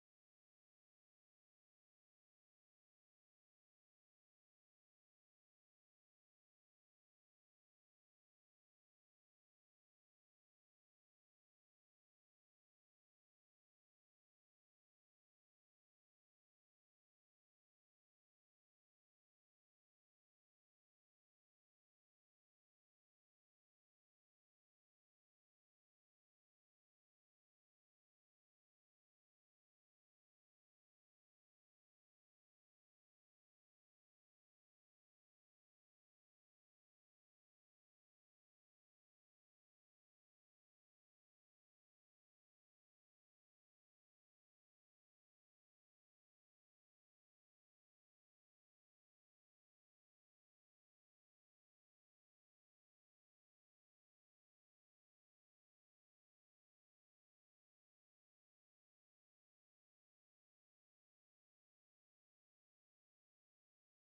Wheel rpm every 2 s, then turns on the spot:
0, 0, 0, 0, 0, 0, 0, 0, 0, 0, 0, 0, 0, 0, 0, 0, 0, 0, 0, 0, 0, 0, 0, 0, 0, 0, 0, 0, 0, 0, 0, 0.
none